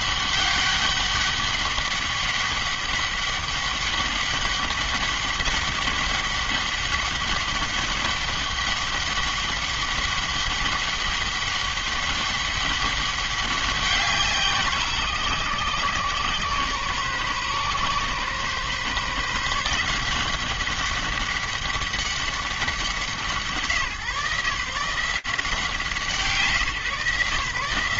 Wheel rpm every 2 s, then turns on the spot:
200, 200, 200, 200, 200, 200, 200, 160, 130, 140, 190, 170, 170, 140.
none